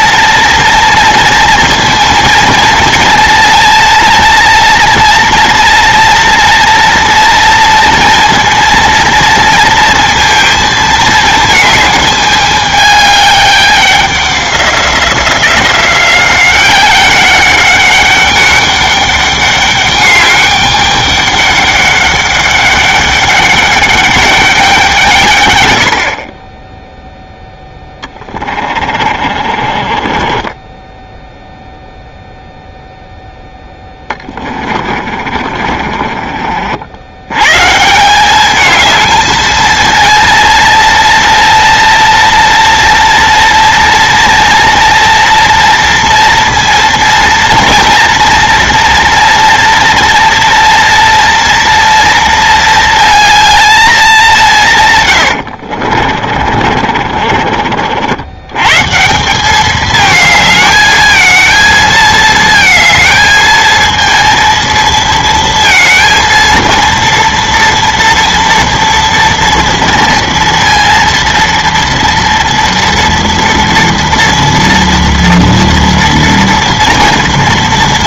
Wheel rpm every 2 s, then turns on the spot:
230, 230, 230, 230, 230, 220, 210, 180, 190, 200, 200, 200, 170, 10, 40, 10, 0, 40, 80, 220, 230, 230, 230, 230, 230, 230, 220, 120, 40, 150, 220, 220, 230, 230, 230, 230, 230, 230, 230.
28-32 34-36 56-58